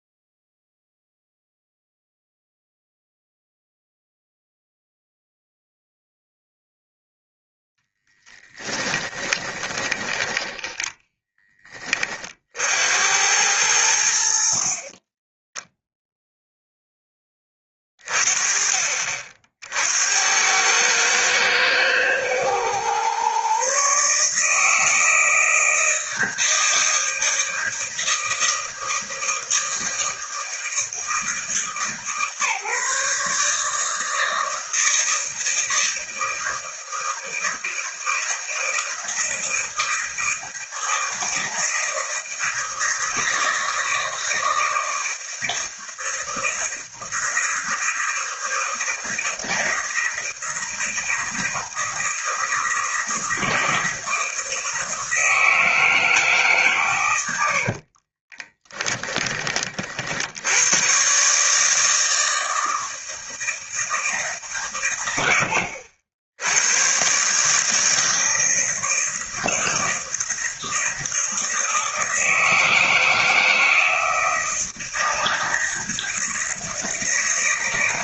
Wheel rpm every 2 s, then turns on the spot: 0, 0, 0, 0, 10, 10, 70, 40, 0, 40, 100, 120, 160, 160, 160, 160, 150, 160, 160, 160, 160, 160, 170, 160, 160, 160, 160, 160, 120, 20, 120, 160, 110, 100, 160, 160, 160, 170, 160.
8-12 58-60